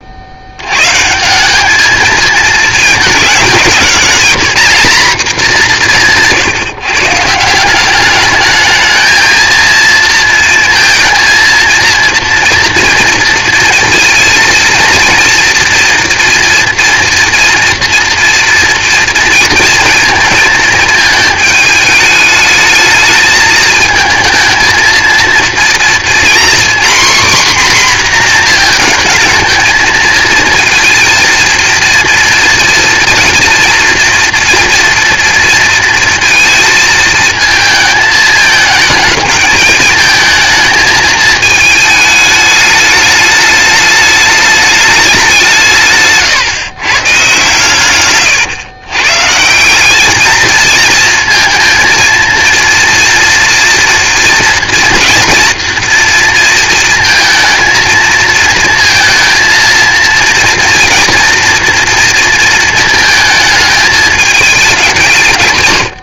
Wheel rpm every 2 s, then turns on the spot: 100, 220, 210, 150, 210, 230, 230, 230, 240, 240, 220, 220, 220, 250, 230, 230, 230, 230, 220, 220, 220, 210, 210, 130, 130, 220, 230, 230, 230, 230, 230, 230, 200.
none